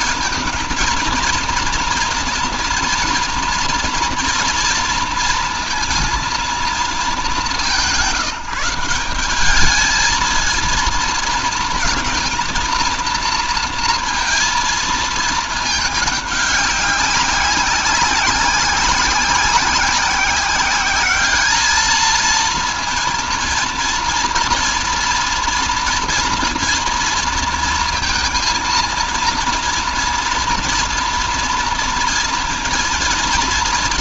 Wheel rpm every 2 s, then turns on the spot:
230, 230, 230, 210, 180, 230, 230, 220, 200, 190, 200, 230, 230, 240, 230, 230, 230.
none